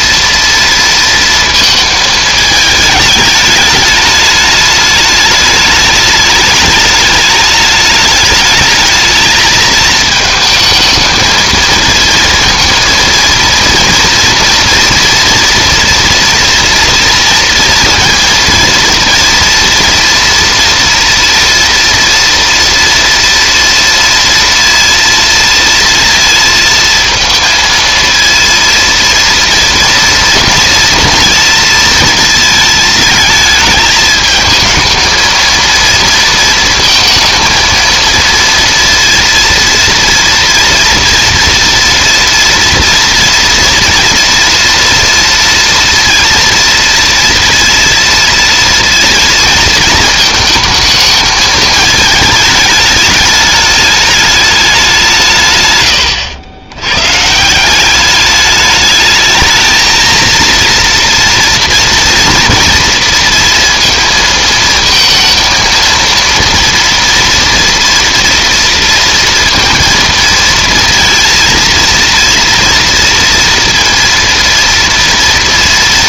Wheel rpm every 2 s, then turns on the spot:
230, 220, 210, 210, 210, 220, 230, 230, 230, 230, 240, 230, 230, 230, 230, 230, 220, 220, 230, 230, 230, 230, 230, 230, 230, 220, 210, 200, 100, 210, 230, 230, 230, 230, 230, 230, 230, 230.
none